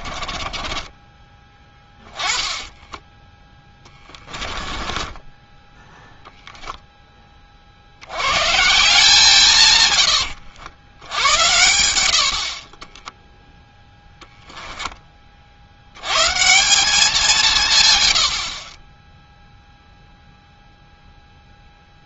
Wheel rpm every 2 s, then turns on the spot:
20, 30, 20, 10, 150, 90, 20, 10, 180, 20, 0.
0-6